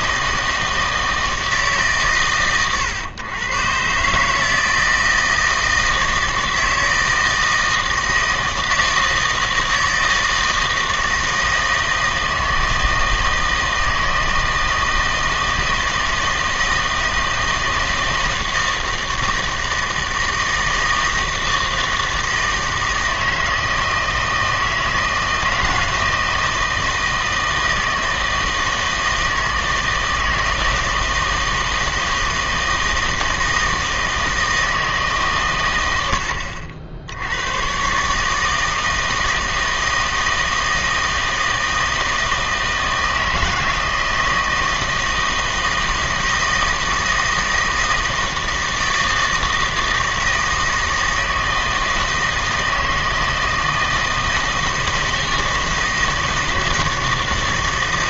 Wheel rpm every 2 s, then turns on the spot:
160, 110, 160, 160, 160, 160, 160, 160, 160, 160, 160, 160, 160, 160, 160, 160, 160, 160, 70, 160, 160, 160, 160, 160, 160, 160, 160, 160, 160.
none